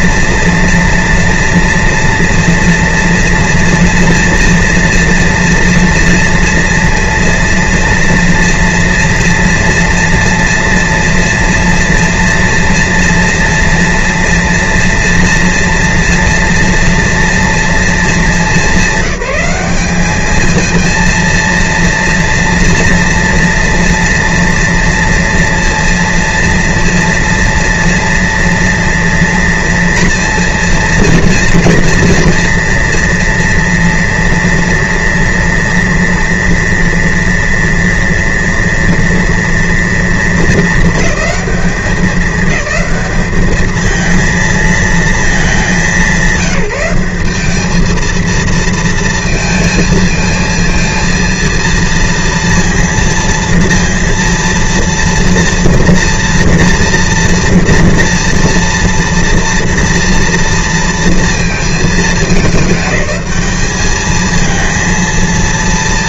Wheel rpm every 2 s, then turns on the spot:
230, 230, 230, 230, 230, 230, 230, 230, 240, 230, 220, 240, 230, 230, 230, 230, 230, 240, 230, 230, 230, 210, 220, 190, 230, 220, 230, 230, 230, 230, 230, 210, 220.
none